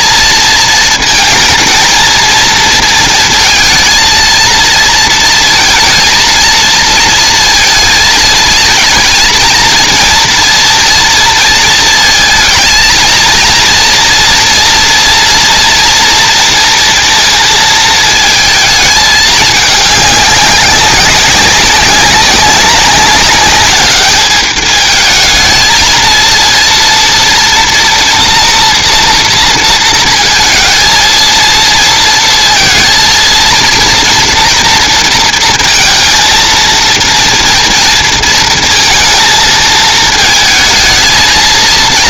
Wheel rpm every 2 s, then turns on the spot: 230, 220, 230, 220, 220, 230, 220, 230, 230, 220, 200, 200, 210, 230, 230, 220, 230, 240, 230, 230, 220.
none